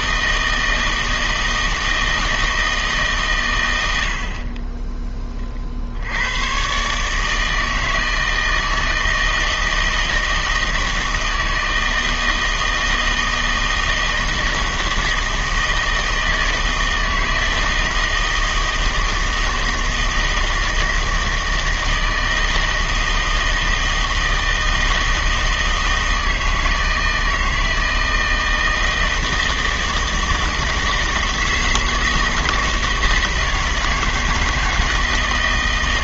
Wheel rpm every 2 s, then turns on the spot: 160, 150, 20, 130, 160, 160, 160, 160, 160, 160, 160, 160, 160, 160, 160, 160, 160, 160.
4-6